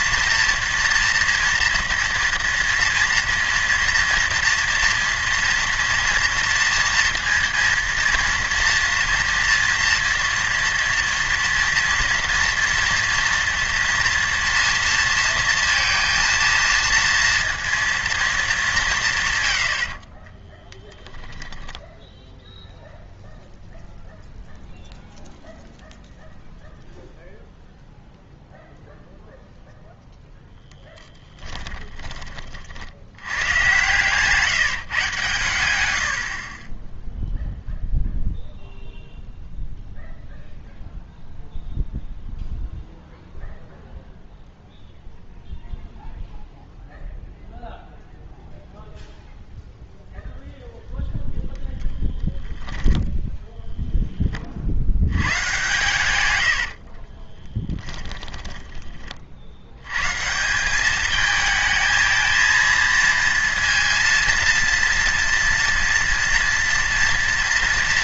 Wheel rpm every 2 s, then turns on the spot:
240, 230, 230, 230, 230, 230, 230, 230, 230, 210, 20, 0, 0, 0, 0, 0, 50, 160, 30, 0, 0, 0, 0, 0, 0, 0, 10, 40, 80, 20, 170, 230, 230, 230.
20-22 56-58